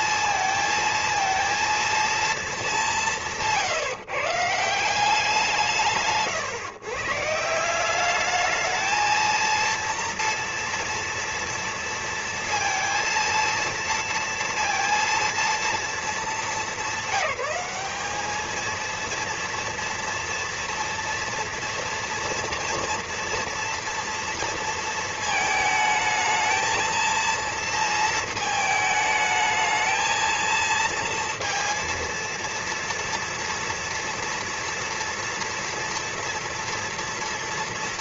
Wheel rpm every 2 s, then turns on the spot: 230, 220, 160, 120, 210, 230, 230, 230, 210, 220, 230, 230, 230, 230, 220, 230, 230, 230, 230.
none